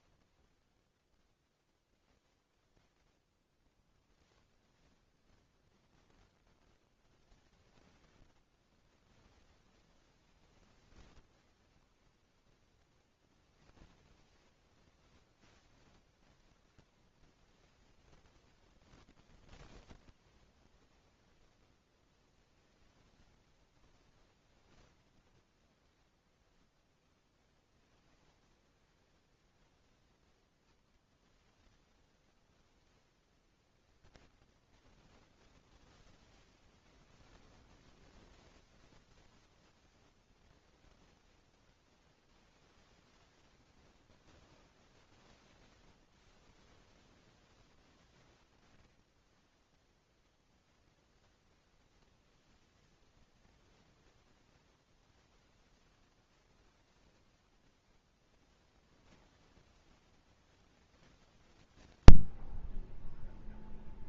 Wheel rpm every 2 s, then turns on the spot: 0, 0, 0, 0, 10, 0, 10, 0, 0, 0, 0, 0, 0, 0, 0, 0, 0, 10, 0, 0, 0, 0, 0, 0, 10, 0, 0, 0, 0, 0, 0, 0.
none